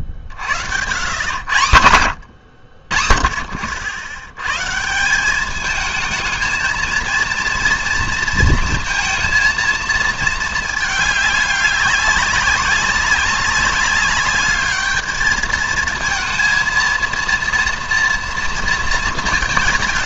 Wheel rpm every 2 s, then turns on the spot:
80, 80, 130, 220, 230, 220, 200, 210, 230, 230.
none